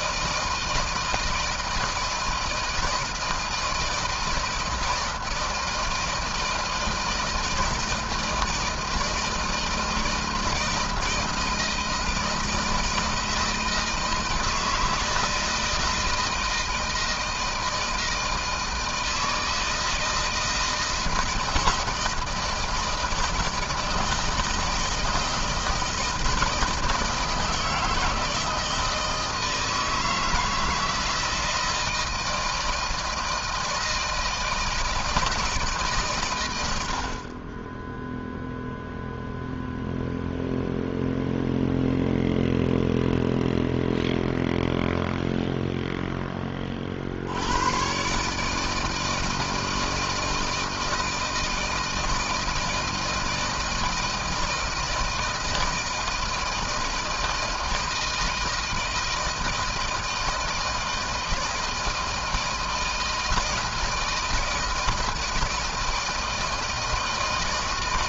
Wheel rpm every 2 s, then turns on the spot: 160, 160, 160, 160, 160, 160, 160, 160, 160, 160, 160, 160, 160, 160, 160, 160, 160, 160, 110, 0, 0, 0, 0, 30, 150, 160, 160, 160, 160, 160, 160, 160, 160, 160.
none